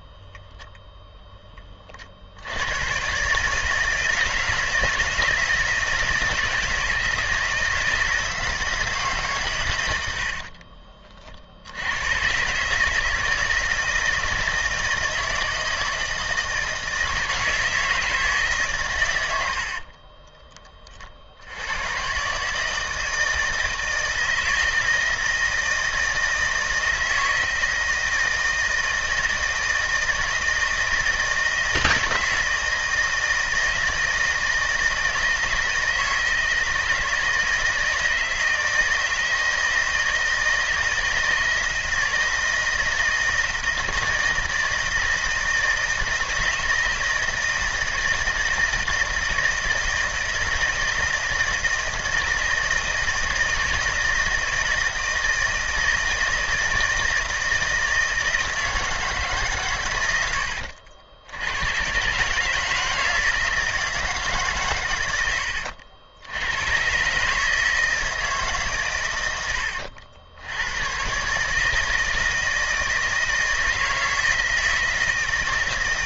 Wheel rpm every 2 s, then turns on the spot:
0, 110, 170, 160, 150, 40, 150, 160, 160, 130, 40, 160, 160, 160, 160, 160, 160, 160, 160, 160, 160, 160, 160, 160, 160, 160, 160, 160, 160, 160, 80, 160, 110, 120, 130, 110, 160, 160.
none